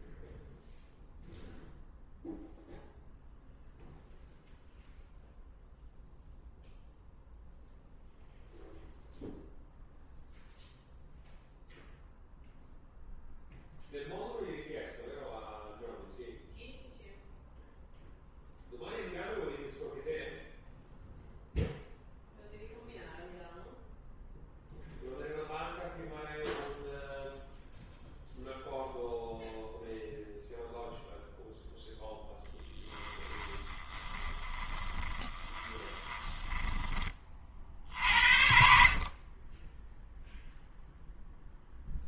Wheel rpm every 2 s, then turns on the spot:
0, 0, 0, 0, 0, 0, 0, 0, 0, 0, 0, 0, 0, 0, 0, 0, 10, 20, 10, 60, 0.
32-36